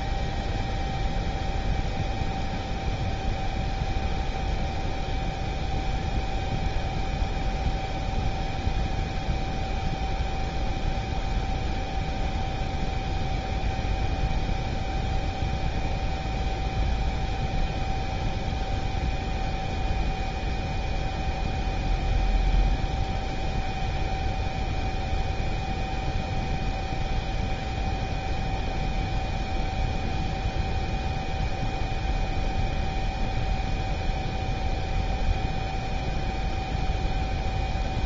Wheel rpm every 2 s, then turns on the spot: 0, 0, 0, 0, 0, 0, 0, 0, 0, 0, 0, 0, 0, 0, 0, 0, 0, 0, 0.
none